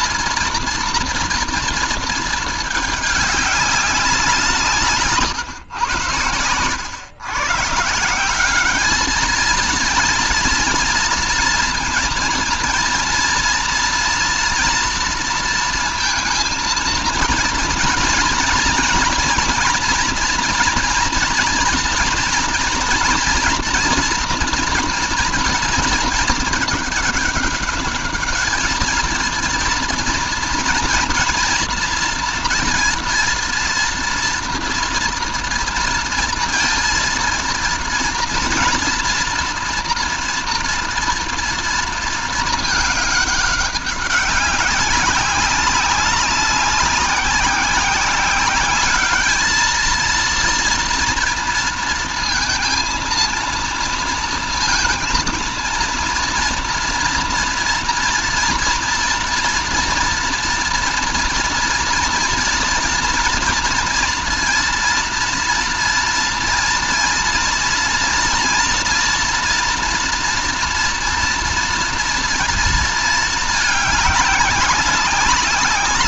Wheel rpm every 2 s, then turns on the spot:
230, 210, 160, 130, 210, 230, 230, 230, 230, 240, 230, 240, 230, 210, 220, 230, 230, 230, 230, 240, 230, 210, 190, 190, 210, 230, 230, 230, 230, 230, 230, 230, 230, 240, 240, 230, 220, 200.
4-6